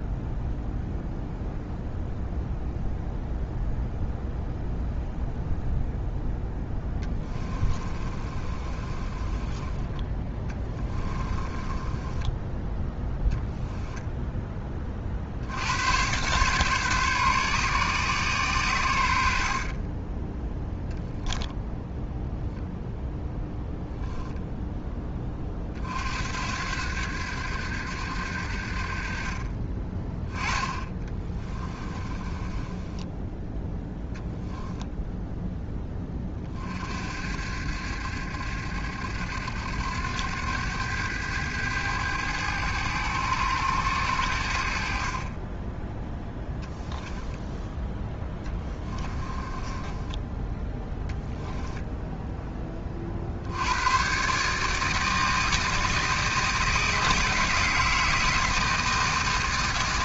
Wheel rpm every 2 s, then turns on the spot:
0, 0, 0, 10, 30, 20, 10, 30, 130, 100, 0, 0, 10, 80, 50, 20, 20, 0, 40, 70, 100, 100, 50, 10, 20, 10, 30, 150, 160, 160.
6-12 30-34 46-50